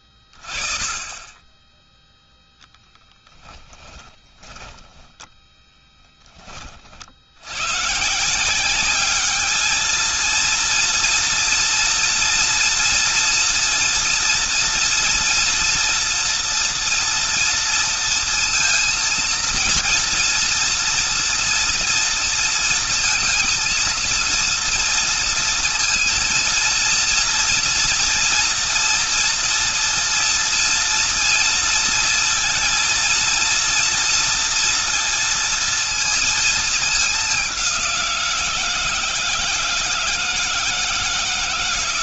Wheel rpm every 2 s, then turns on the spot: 30, 0, 10, 60, 200, 230, 230, 230, 230, 230, 230, 230, 230, 230, 230, 230, 230, 230, 210, 160, 150.
4-6